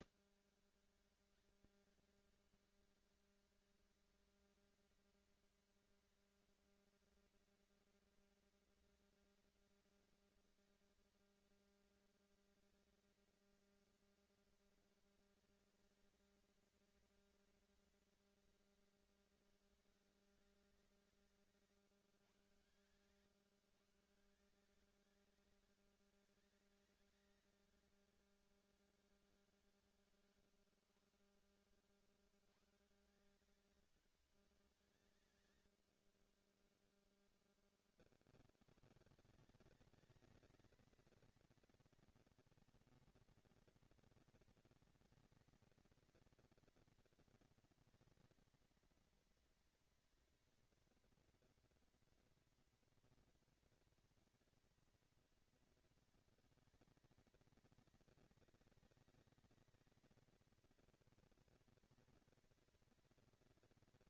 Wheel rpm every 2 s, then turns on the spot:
180, 220, 230, 230, 230, 220, 230, 230, 220, 220, 180, 110, 170, 190, 200, 130, 160, 120, 0, 130, 220, 230, 230, 230, 230, 240, 230, 230, 220, 210, 230, 230.
none